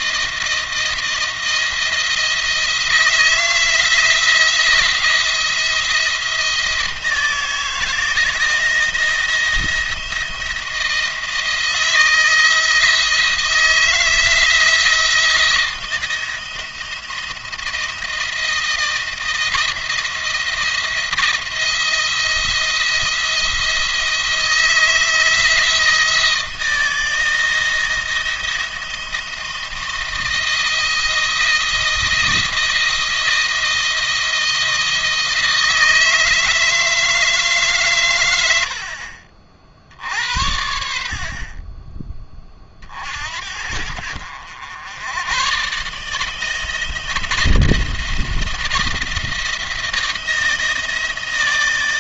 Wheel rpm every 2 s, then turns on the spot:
170, 160, 170, 170, 170, 170, 160, 160, 170, 170, 170, 170, 170, 160, 170, 170, 170, 160, 160, 80, 70, 40, 90, 160, 170, 160.
none